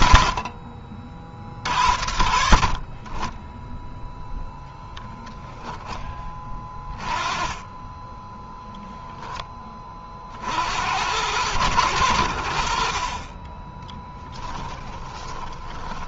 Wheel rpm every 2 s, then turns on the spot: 60, 40, 0, 30, 0, 80, 40, 20.
14-16